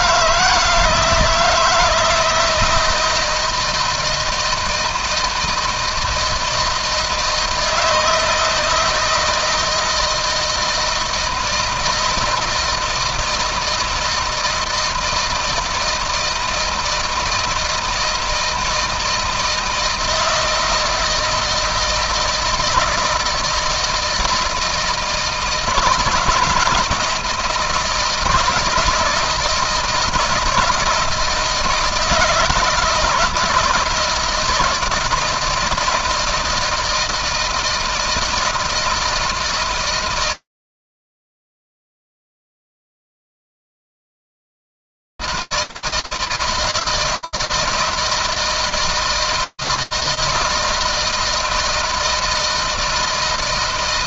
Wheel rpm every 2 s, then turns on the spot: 160, 160, 160, 160, 160, 170, 160, 160, 160, 160, 160, 160, 160, 170, 160, 160, 160, 170, 160, 160, 160, 160, 160, 160, 160, 160, 160.
none